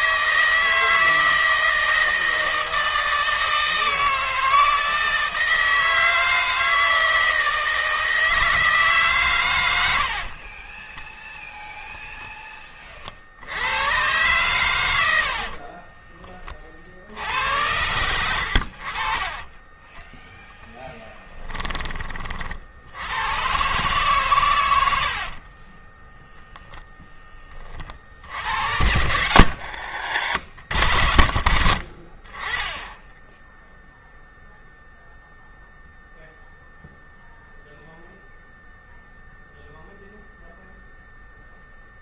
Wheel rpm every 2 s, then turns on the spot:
160, 160, 160, 160, 140, 10, 60, 80, 70, 50, 10, 80, 70, 0, 80, 60, 20, 0, 0, 0, 0.
10-12 14-16 24-26 28-30